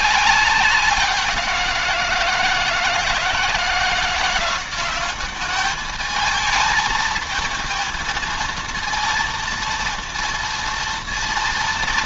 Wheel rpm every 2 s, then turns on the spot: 180, 160, 200, 220, 230, 230.
none